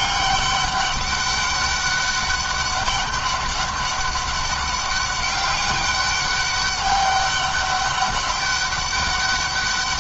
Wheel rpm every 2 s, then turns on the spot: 200, 200, 200, 200, 200.
none